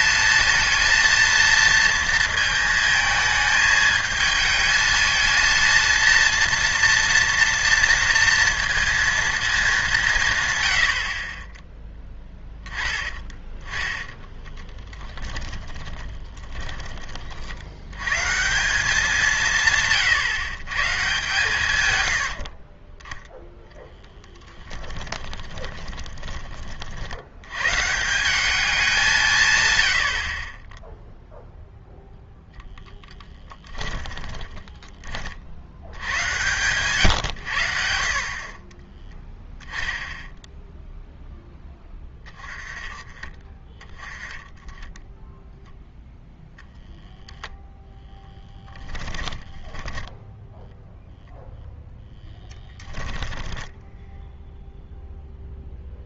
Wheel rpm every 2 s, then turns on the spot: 230, 220, 220, 230, 230, 110, 10, 10, 20, 170, 130, 50, 10, 30, 190, 20, 0, 10, 110, 20, 0, 20, 10, 0, 10, 0, 10, 0.
14-16 22-26 34-36 48-50